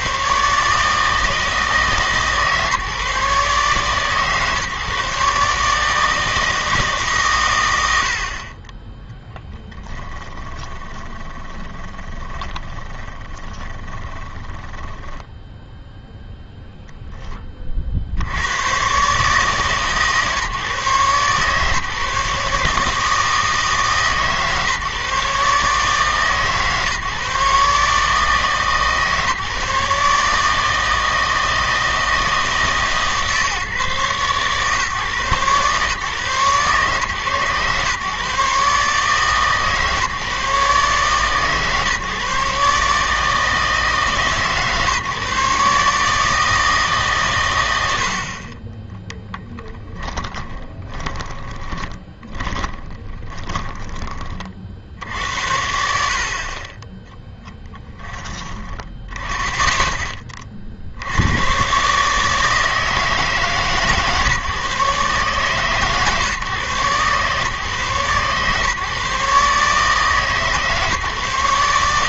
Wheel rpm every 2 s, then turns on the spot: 150, 150, 140, 160, 30, 20, 20, 20, 0, 110, 140, 150, 140, 150, 150, 160, 160, 130, 130, 140, 140, 140, 140, 160, 20, 20, 10, 60, 30, 10, 50, 160, 140, 130, 140, 150.
10-16 50-54